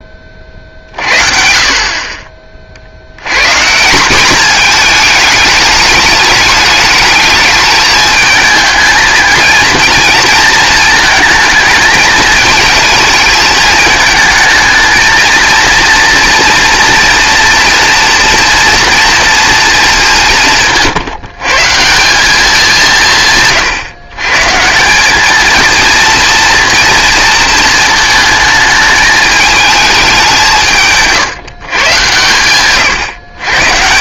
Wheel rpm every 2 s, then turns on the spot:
40, 40, 220, 210, 220, 230, 220, 220, 230, 230, 160, 180, 160, 230, 220, 160, 120.
none